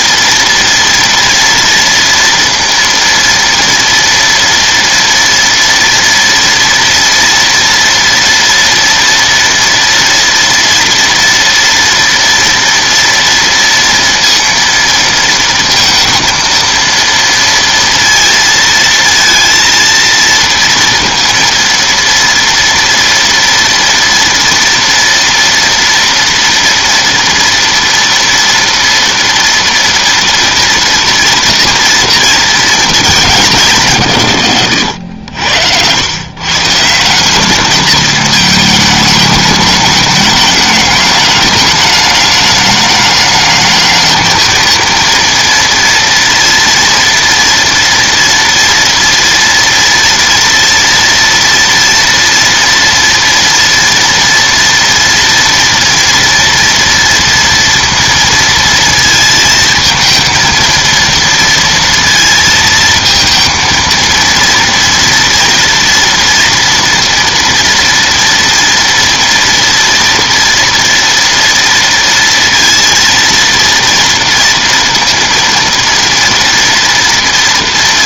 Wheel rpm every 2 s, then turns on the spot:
230, 230, 230, 230, 230, 230, 230, 230, 230, 230, 230, 230, 230, 230, 230, 230, 230, 110, 130, 220, 220, 210, 220, 230, 230, 230, 240, 230, 240, 230, 230, 230, 230, 230, 230, 230, 230, 230, 230.
none